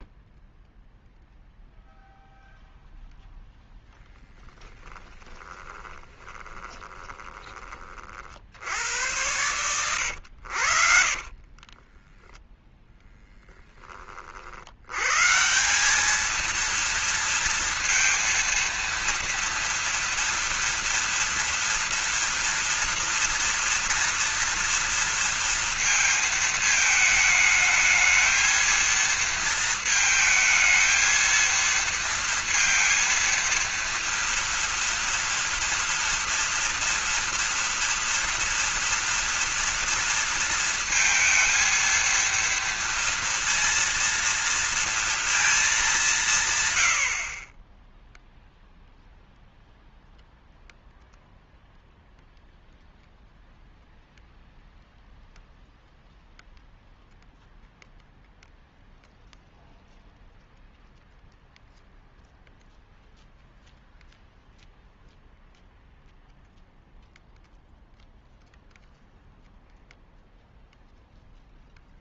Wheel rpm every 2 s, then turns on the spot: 0, 0, 10, 20, 70, 60, 0, 80, 230, 230, 230, 230, 230, 220, 220, 220, 230, 230, 230, 230, 230, 230, 230, 130, 0, 0, 0, 0, 0, 0, 0, 0, 0, 0, 0, 0.
4-8 10-12